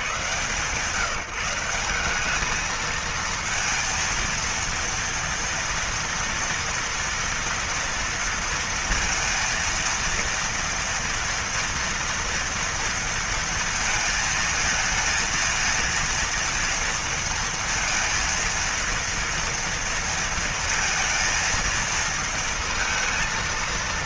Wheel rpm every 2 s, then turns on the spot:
110, 200, 230, 230, 230, 230, 230, 230, 230, 230, 230, 230.
none